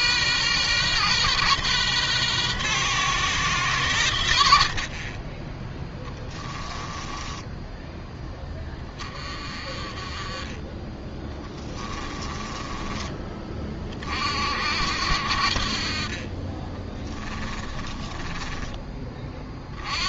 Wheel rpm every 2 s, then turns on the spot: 120, 130, 50, 10, 20, 10, 20, 60, 20, 30.
4-8 16-18